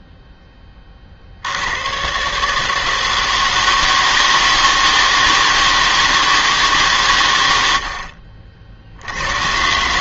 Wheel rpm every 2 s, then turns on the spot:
20, 150, 160, 160, 50.
none